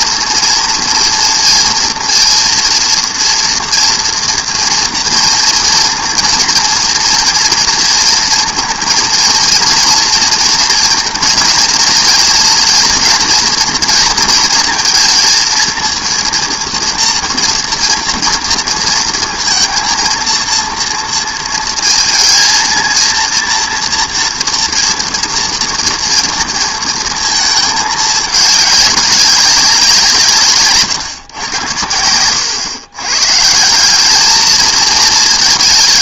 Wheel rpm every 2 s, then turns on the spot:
230, 240, 230, 230, 230, 230, 230, 230, 230, 230, 230, 230, 230, 230, 210, 140, 110, 220.
none